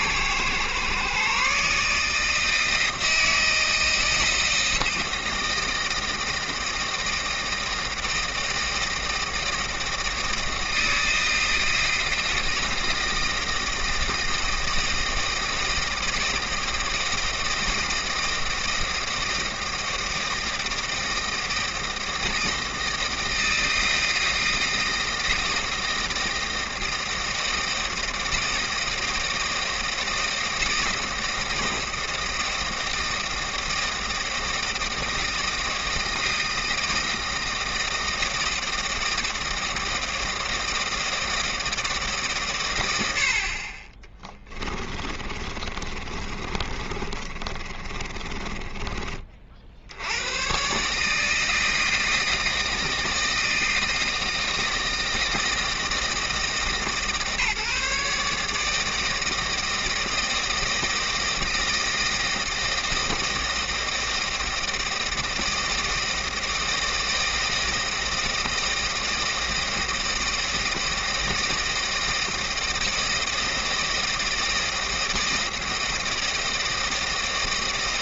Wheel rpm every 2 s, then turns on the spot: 130, 160, 160, 160, 160, 160, 160, 160, 160, 160, 160, 160, 170, 160, 160, 160, 160, 160, 160, 160, 160, 110, 20, 30, 20, 130, 160, 160, 150, 160, 160, 160, 160, 160, 160, 160, 160, 160, 160.
44-50